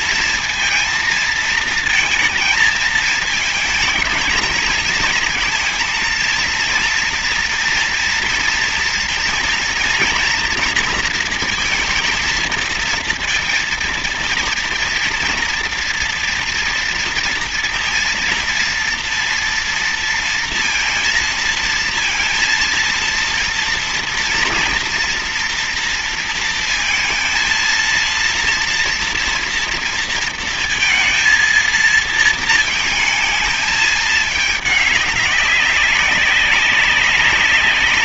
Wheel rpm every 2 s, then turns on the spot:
230, 220, 220, 230, 230, 230, 230, 230, 230, 230, 230, 230, 230, 230, 230, 230, 220, 210, 200.
none